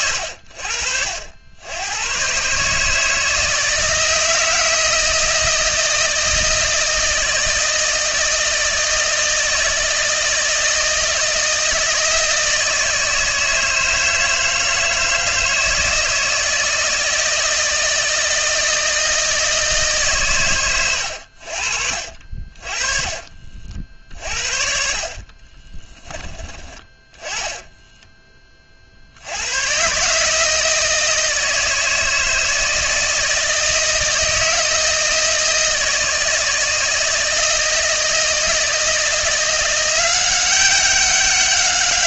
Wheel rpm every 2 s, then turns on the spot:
70, 160, 160, 160, 160, 160, 160, 160, 160, 160, 100, 30, 50, 20, 50, 160, 160, 160, 160, 170, 190.
22-24